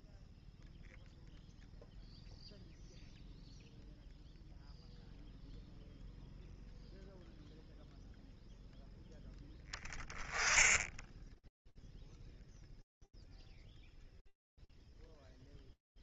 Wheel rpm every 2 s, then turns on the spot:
0, 0, 0, 0, 0, 10, 0, 0.
none